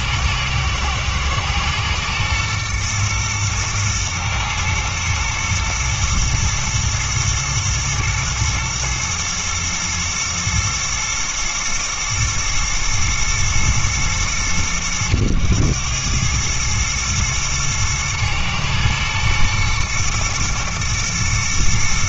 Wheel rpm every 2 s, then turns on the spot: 110, 120, 120, 120, 110, 110, 110, 100, 110, 110, 120.
none